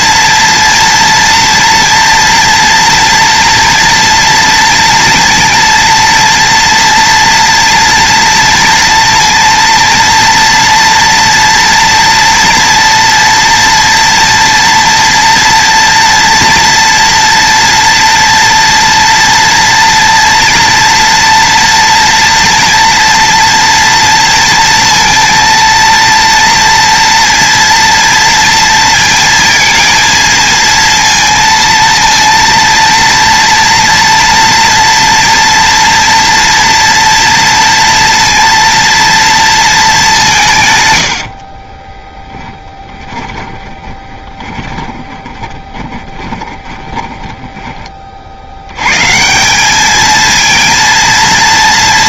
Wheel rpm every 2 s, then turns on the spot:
230, 230, 240, 230, 230, 230, 230, 230, 230, 230, 230, 230, 230, 230, 230, 230, 230, 230, 230, 230, 180, 10, 20, 30, 100, 230.
42-48